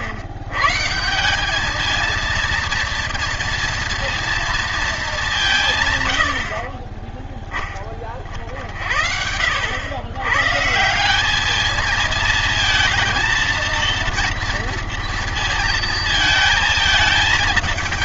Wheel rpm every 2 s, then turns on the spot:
150, 230, 220, 30, 60, 160, 230, 230, 220.
none